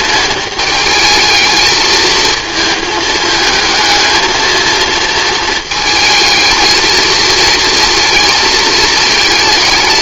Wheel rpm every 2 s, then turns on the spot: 220, 220, 220, 220, 220.
none